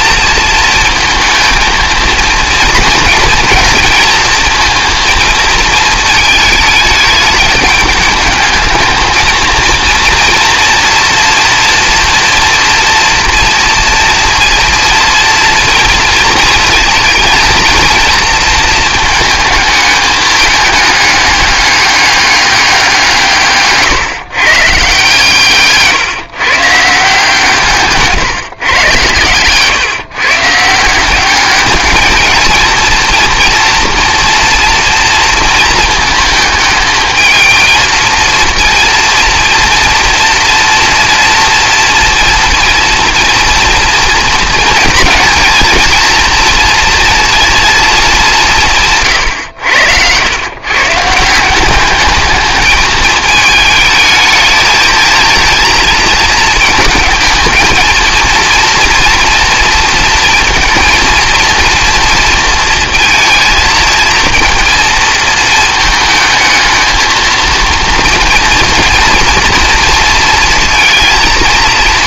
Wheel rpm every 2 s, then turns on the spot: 230, 230, 230, 210, 220, 230, 230, 230, 230, 230, 210, 190, 140, 150, 130, 170, 230, 230, 220, 230, 230, 230, 230, 230, 160, 130, 210, 220, 220, 230, 230, 230, 230, 220, 230, 230.
none